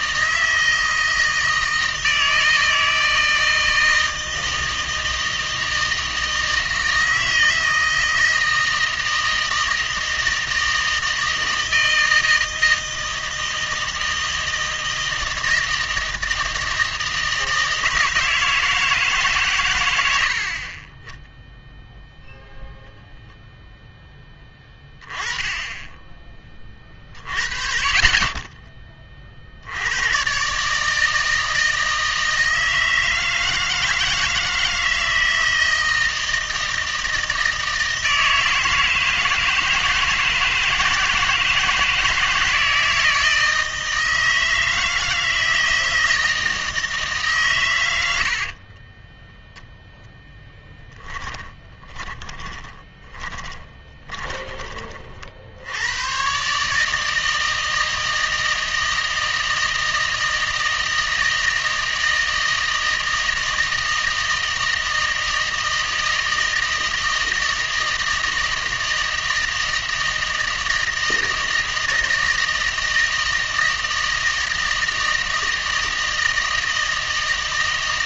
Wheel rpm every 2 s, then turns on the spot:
160, 160, 160, 160, 160, 160, 160, 160, 160, 160, 30, 0, 10, 30, 20, 150, 160, 160, 160, 160, 160, 160, 160, 160, 30, 10, 20, 30, 150, 160, 160, 160, 160, 160, 160, 160, 160, 160, 160.
48-54